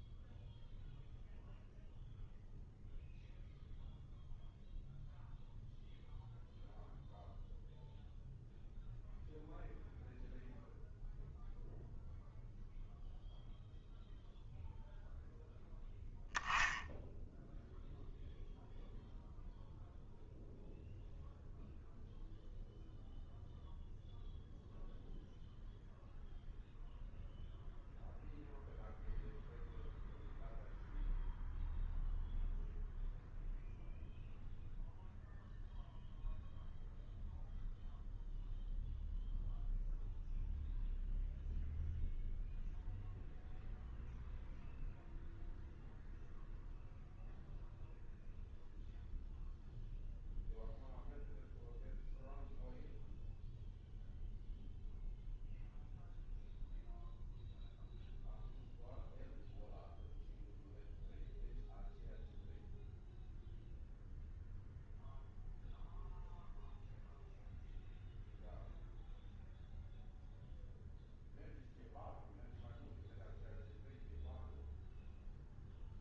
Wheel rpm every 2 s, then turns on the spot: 0, 0, 0, 0, 0, 0, 0, 0, 10, 0, 0, 0, 0, 0, 0, 0, 0, 0, 0, 0, 0, 0, 0, 0, 0, 0, 0, 0, 0, 0, 0, 0, 0, 0, 0, 0, 0, 0.
none